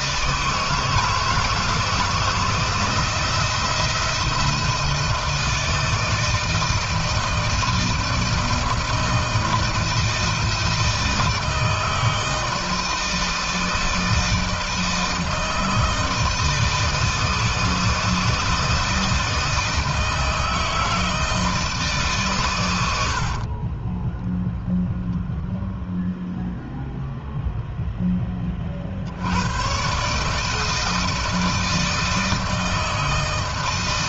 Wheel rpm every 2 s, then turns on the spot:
160, 160, 160, 160, 160, 160, 160, 160, 160, 160, 160, 110, 0, 0, 40, 160, 160.
none